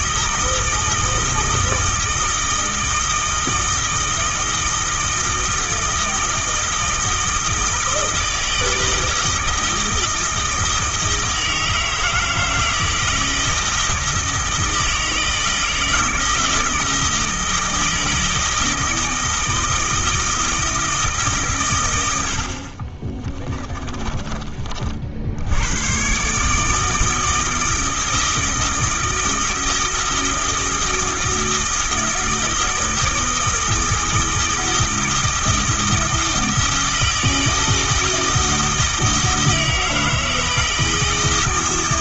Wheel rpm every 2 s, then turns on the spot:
160, 160, 160, 160, 160, 160, 160, 160, 160, 160, 160, 40, 50, 150, 160, 160, 160, 160, 160, 160, 160.
22-24